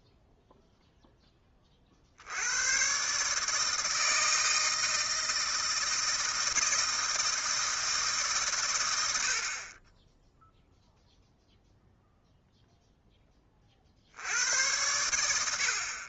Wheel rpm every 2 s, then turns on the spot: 0, 90, 160, 160, 130, 0, 0, 90.
none